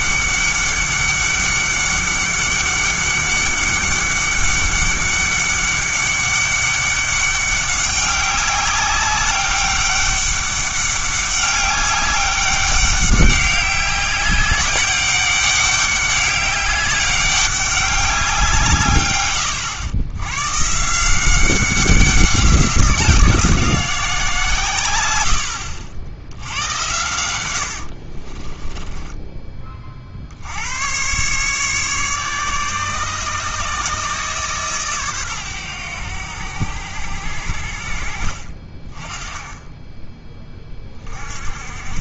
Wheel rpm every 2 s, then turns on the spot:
200, 200, 200, 200, 190, 200, 200, 200, 200, 140, 150, 180, 120, 90, 20, 100, 150, 130, 90, 30, 30.
28-30